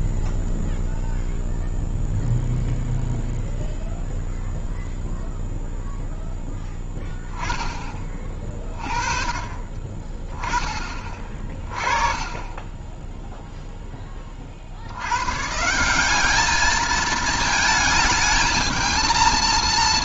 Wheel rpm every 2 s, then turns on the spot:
0, 0, 0, 0, 30, 30, 20, 50, 210, 220.
none